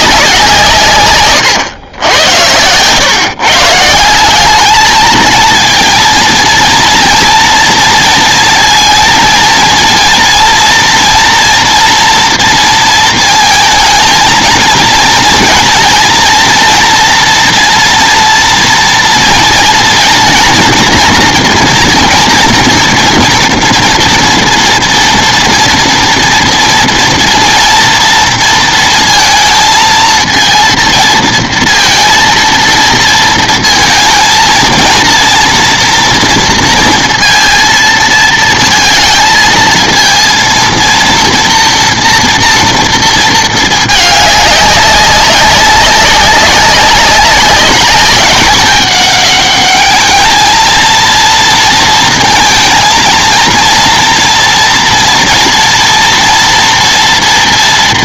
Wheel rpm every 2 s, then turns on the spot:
150, 100, 210, 230, 230, 230, 230, 230, 230, 230, 230, 230, 230, 230, 230, 230, 230, 230, 230, 230, 230, 230, 200, 190, 200, 220, 230, 230, 230.
none